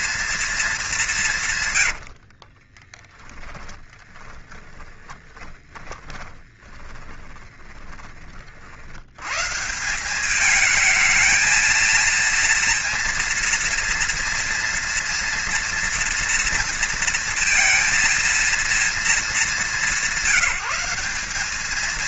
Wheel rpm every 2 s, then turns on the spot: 230, 50, 10, 10, 40, 210, 230, 230, 230, 230, 190.
2-8